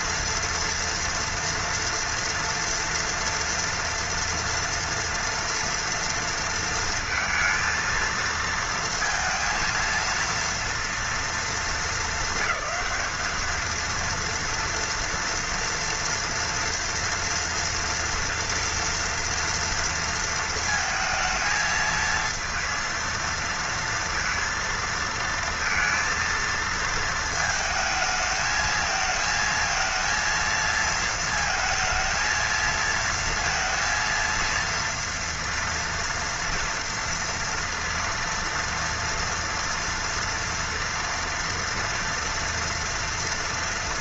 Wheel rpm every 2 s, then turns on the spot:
230, 230, 230, 230, 230, 230, 200, 230, 230, 240, 220, 220, 230, 230, 220, 230, 230, 230, 230, 230, 230, 240.
none